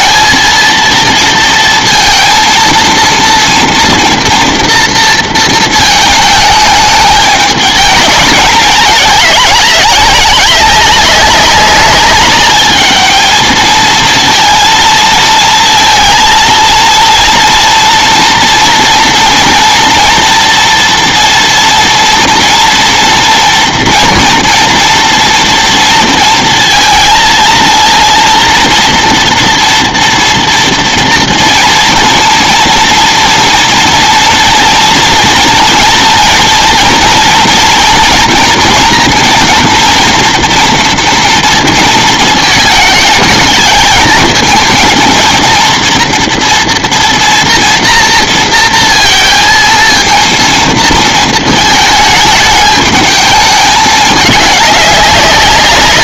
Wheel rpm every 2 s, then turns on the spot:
230, 230, 230, 210, 210, 200, 210, 230, 230, 240, 240, 230, 230, 230, 230, 230, 230, 230, 230, 230, 230, 210, 230, 230, 230, 230, 210, 200.
none